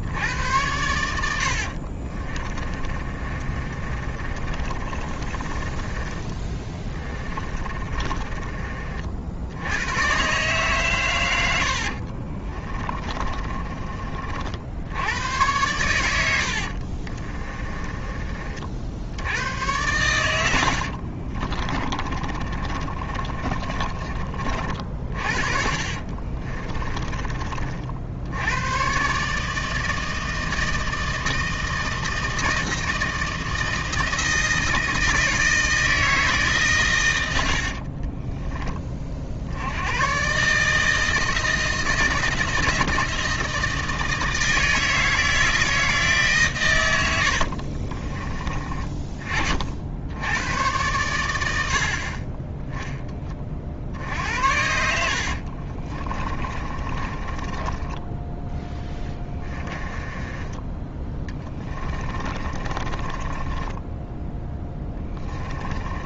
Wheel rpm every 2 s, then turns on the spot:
70, 40, 30, 20, 30, 130, 30, 80, 60, 50, 80, 30, 50, 20, 110, 160, 160, 160, 120, 30, 160, 170, 160, 110, 30, 110, 10, 70, 30, 10, 10, 30, 10.
2-10 12-14 16-18 20-24 26-28 48-50 54-60 62-66